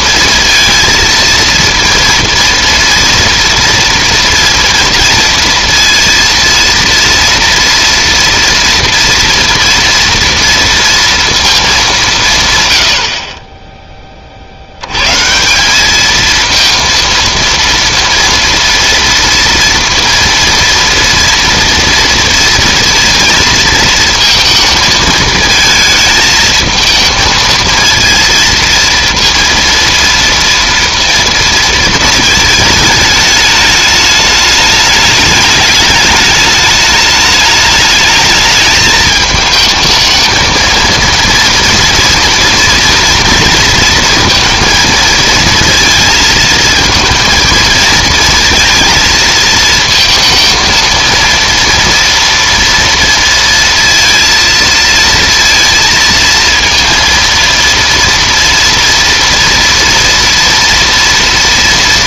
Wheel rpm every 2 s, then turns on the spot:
230, 230, 230, 230, 230, 230, 50, 120, 230, 230, 230, 230, 220, 220, 230, 230, 220, 210, 210, 220, 230, 230, 230, 230, 230, 230, 230, 230, 230, 230, 230.
none